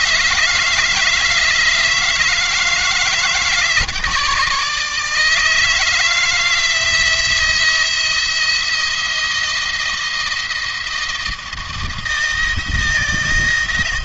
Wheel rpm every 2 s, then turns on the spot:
160, 160, 160, 170, 170, 160, 160.
none